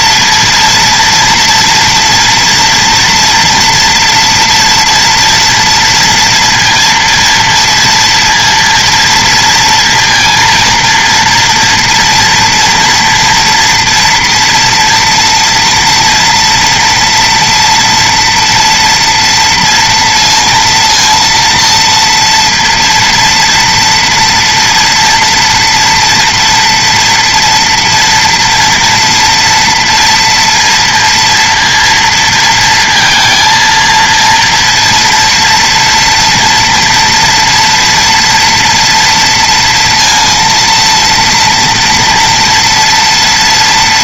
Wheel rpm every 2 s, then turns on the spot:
230, 230, 240, 230, 230, 230, 230, 240, 230, 230, 230, 230, 230, 230, 230, 230, 230, 230, 230, 240, 230, 230.
none